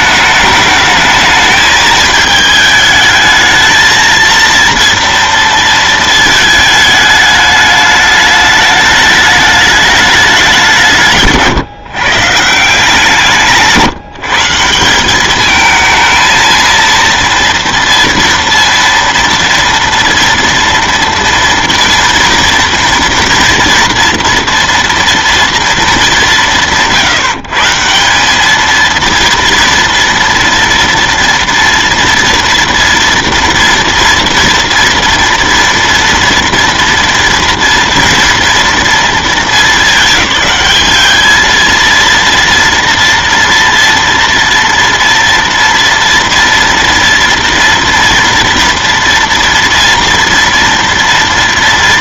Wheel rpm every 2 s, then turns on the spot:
210, 220, 230, 220, 210, 180, 160, 180, 230, 230, 230, 230, 230, 170, 220, 230, 230, 230, 230, 230, 210, 230, 230, 230, 230, 230.
none